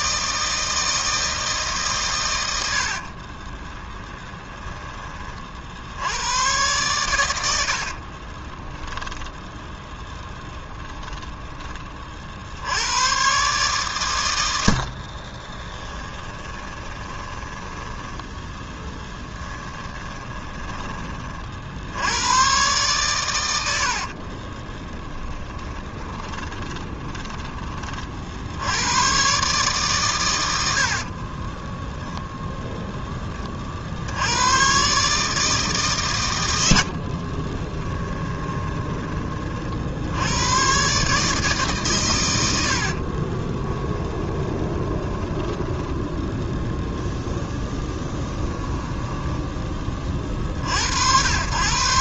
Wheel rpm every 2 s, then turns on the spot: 160, 60, 10, 110, 10, 20, 90, 70, 20, 10, 20, 120, 30, 10, 80, 80, 10, 130, 80, 20, 120, 70, 20, 0, 10, 70.
2-6 8-12 14-20 24-28 36-40 42-46 48-50